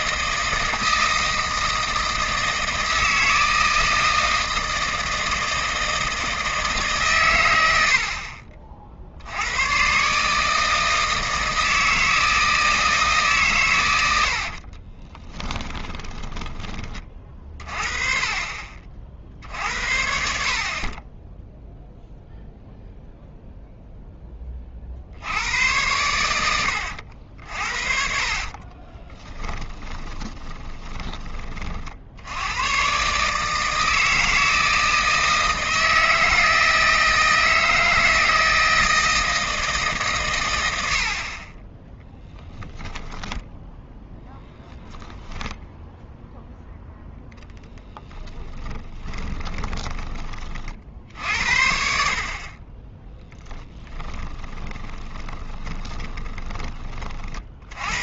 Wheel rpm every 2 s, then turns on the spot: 160, 160, 160, 100, 80, 160, 140, 20, 30, 50, 20, 0, 70, 70, 30, 20, 120, 160, 160, 160, 80, 10, 0, 0, 20, 50, 20, 20, 20.
14-16 26-32 48-50 54-56